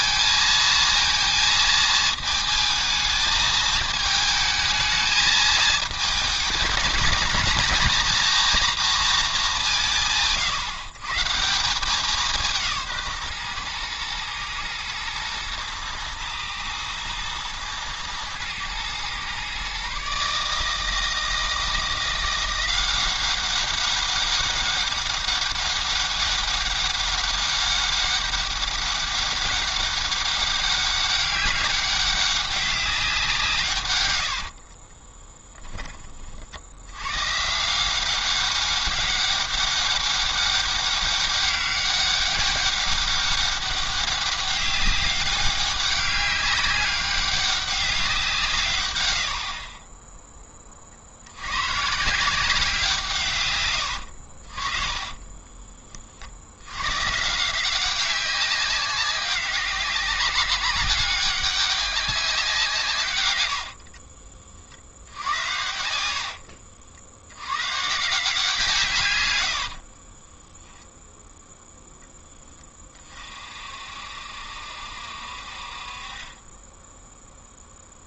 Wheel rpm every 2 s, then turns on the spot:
230, 220, 220, 220, 230, 140, 160, 110, 110, 120, 160, 180, 200, 200, 200, 200, 190, 40, 80, 200, 200, 200, 200, 200, 130, 30, 170, 40, 100, 190, 200, 160, 60, 60, 150, 0, 20, 60, 10.
34-36 54-56